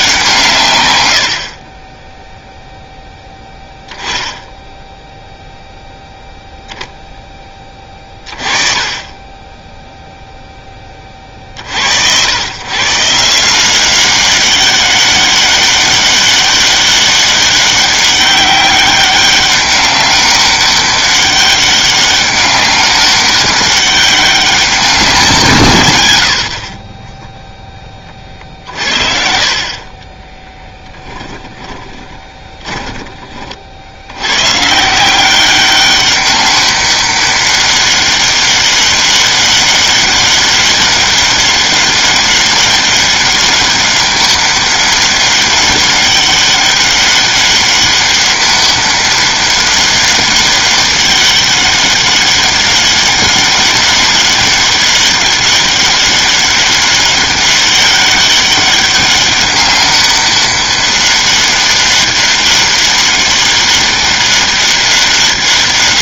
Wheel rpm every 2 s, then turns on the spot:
130, 0, 0, 0, 30, 20, 130, 200, 200, 200, 200, 200, 190, 50, 40, 10, 20, 150, 200, 200, 200, 200, 200, 200, 200, 200, 200, 200, 200, 200, 200, 200, 200.
30-34